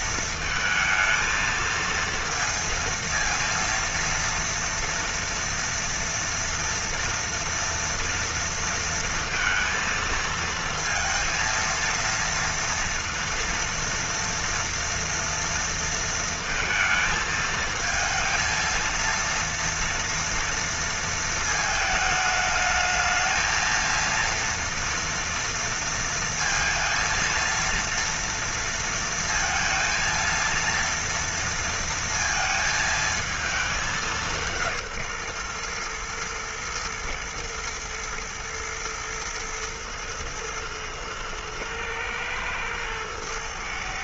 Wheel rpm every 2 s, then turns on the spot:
230, 230, 230, 230, 230, 220, 230, 230, 230, 230, 230, 210, 230, 230, 230, 230, 230, 180, 120, 120, 110, 110.
none